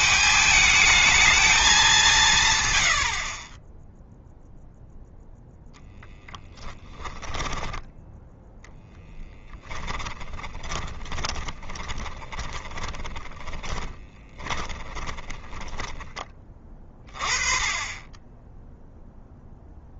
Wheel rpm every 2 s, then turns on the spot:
220, 90, 0, 10, 10, 20, 20, 30, 20, 0.
6-8 10-16